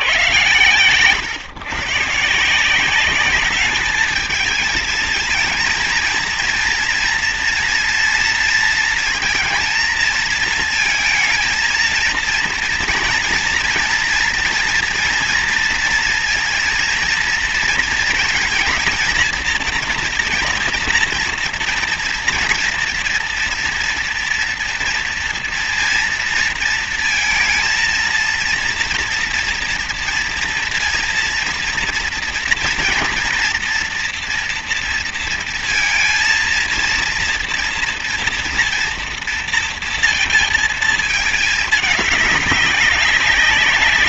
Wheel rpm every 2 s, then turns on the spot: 140, 170, 220, 230, 230, 220, 230, 230, 230, 220, 230, 230, 240, 230, 230, 230, 230, 230, 230, 230, 220, 190.
none